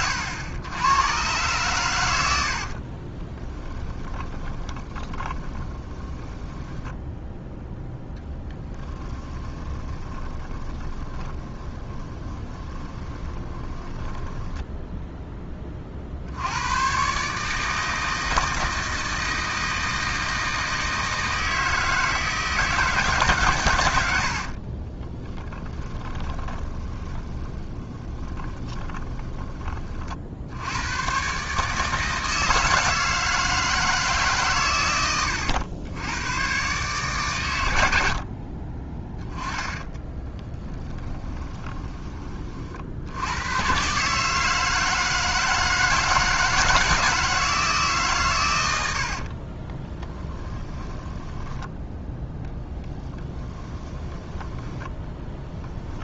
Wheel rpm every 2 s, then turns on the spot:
100, 60, 20, 10, 10, 20, 20, 10, 110, 160, 160, 160, 30, 20, 20, 100, 160, 120, 130, 30, 20, 60, 160, 160, 80, 10, 10, 10.
2-16 24-30 40-42 50-52